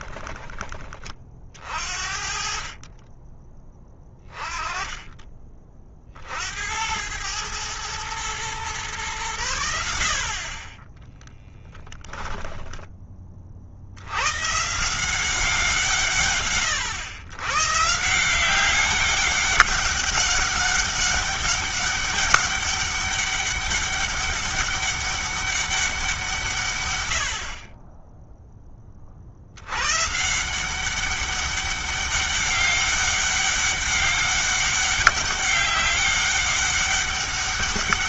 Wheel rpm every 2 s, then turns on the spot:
30, 40, 20, 90, 120, 20, 10, 150, 120, 200, 200, 200, 200, 120, 20, 180, 200, 200, 200.
10-12